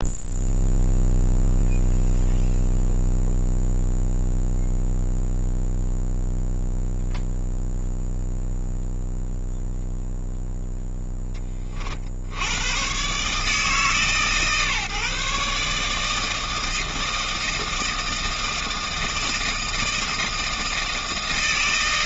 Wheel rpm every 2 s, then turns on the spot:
0, 0, 0, 0, 0, 0, 100, 130, 160, 160, 160.
none